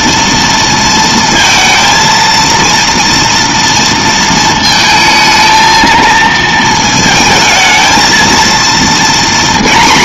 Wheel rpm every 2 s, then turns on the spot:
230, 230, 220, 220, 230.
none